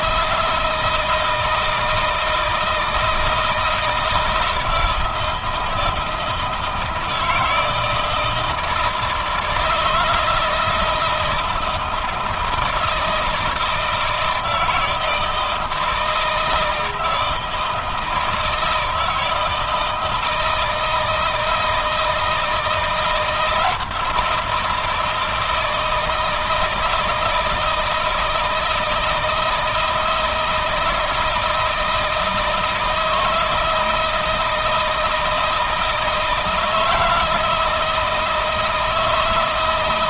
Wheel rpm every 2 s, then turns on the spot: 160, 160, 160, 160, 160, 160, 160, 160, 160, 160, 160, 170, 170, 170, 170, 160, 160, 160, 160, 160.
none